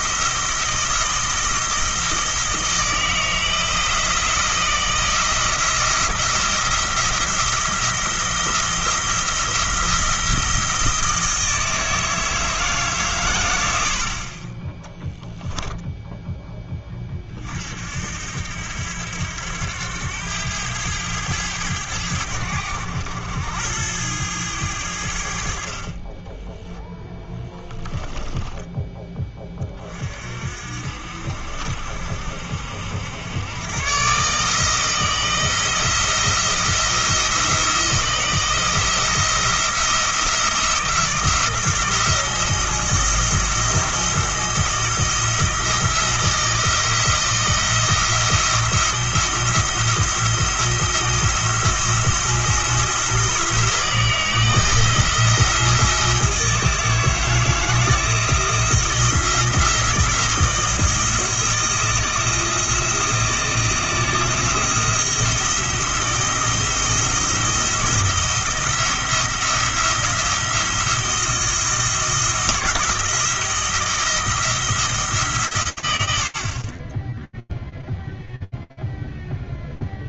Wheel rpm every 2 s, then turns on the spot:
170, 160, 170, 170, 170, 170, 160, 40, 10, 70, 100, 90, 100, 10, 20, 50, 60, 150, 170, 170, 170, 170, 170, 170, 170, 170, 170, 160, 160, 170, 170, 170, 160, 170, 170, 170, 170, 170, 60, 0.
26-28